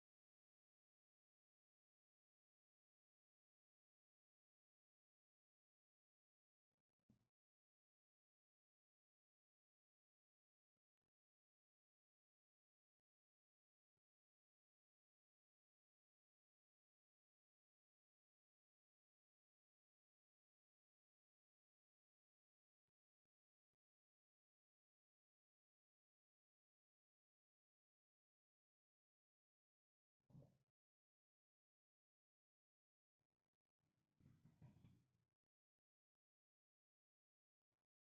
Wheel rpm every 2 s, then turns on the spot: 0, 0, 0, 0, 0, 0, 0, 0, 0, 0, 0, 0, 0, 0, 0, 0, 0, 0, 0.
none